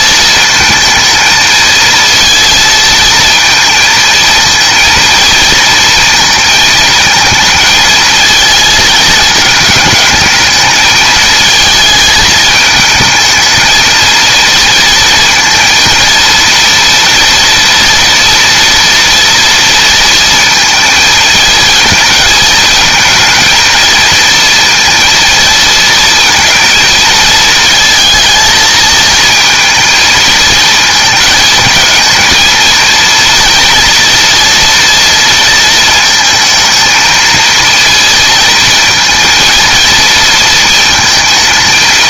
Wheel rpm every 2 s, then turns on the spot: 220, 230, 230, 220, 220, 220, 220, 230, 230, 240, 230, 220, 230, 230, 230, 220, 230, 230, 220, 220, 230.
none